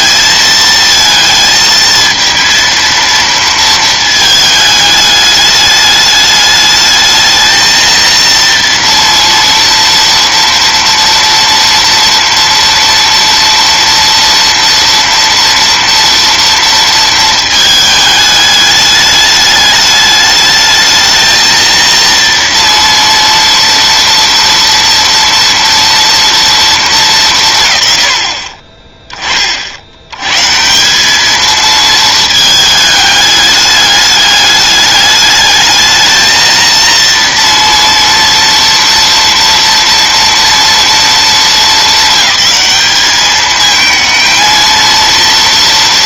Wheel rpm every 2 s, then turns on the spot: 220, 230, 210, 220, 230, 230, 230, 230, 230, 210, 220, 230, 230, 200, 20, 180, 210, 210, 230, 230, 230, 210, 230.
none